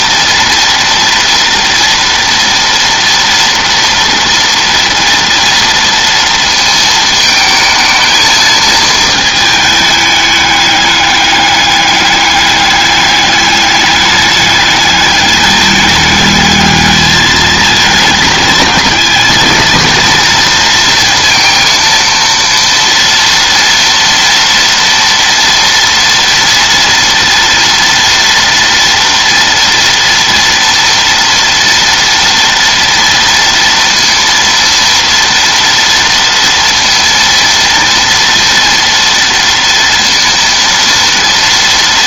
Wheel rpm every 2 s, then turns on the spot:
230, 230, 230, 230, 220, 210, 210, 210, 210, 220, 230, 230, 230, 230, 230, 230, 230, 230, 230, 230, 230.
none